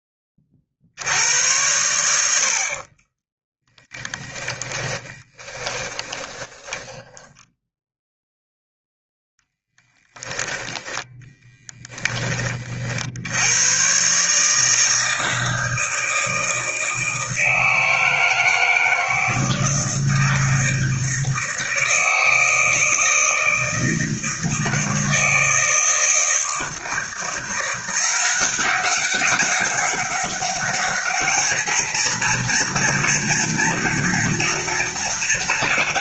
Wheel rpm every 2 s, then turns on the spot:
70, 40, 20, 10, 0, 10, 50, 160, 160, 160, 160, 160, 160, 160, 190, 210, 240, 230.
2-8